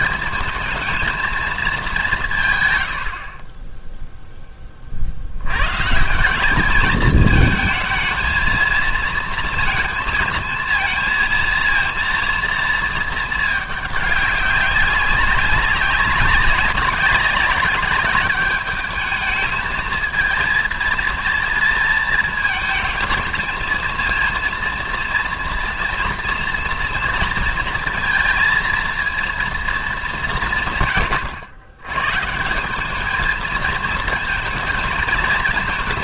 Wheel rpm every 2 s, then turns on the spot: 220, 150, 20, 200, 230, 230, 230, 200, 200, 210, 230, 220, 230, 230, 230, 160, 180, 230.
none